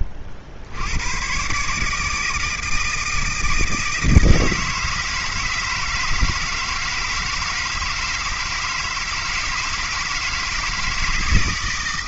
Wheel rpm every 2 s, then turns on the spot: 90, 160, 160, 160, 160, 160.
none